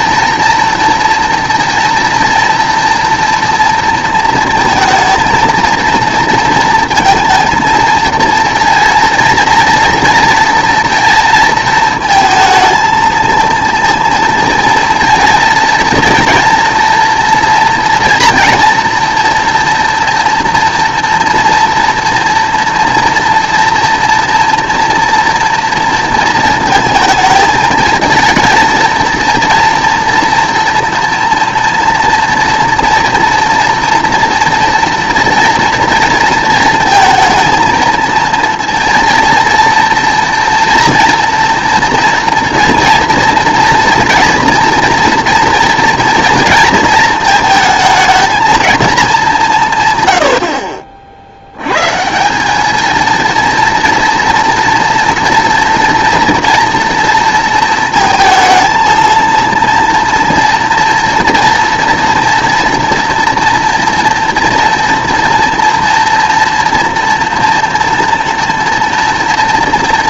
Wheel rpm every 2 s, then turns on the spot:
230, 230, 230, 230, 230, 230, 220, 230, 230, 230, 240, 230, 230, 220, 230, 230, 240, 230, 220, 230, 230, 230, 230, 230, 220, 60, 210, 230, 230, 230, 230, 230, 240, 230, 230.
none